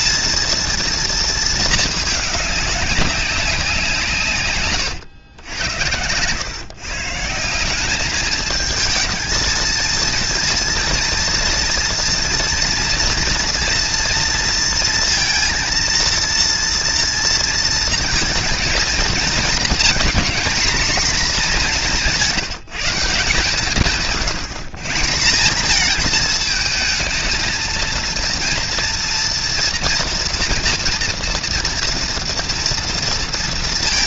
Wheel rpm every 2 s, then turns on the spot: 230, 200, 120, 140, 220, 230, 230, 230, 230, 220, 230, 170, 170, 220, 230, 230, 230.
none